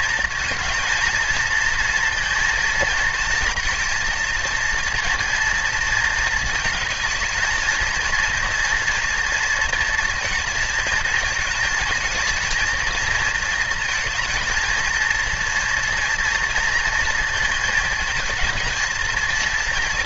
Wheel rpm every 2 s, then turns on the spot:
220, 230, 230, 230, 230, 230, 230, 230, 230, 220.
none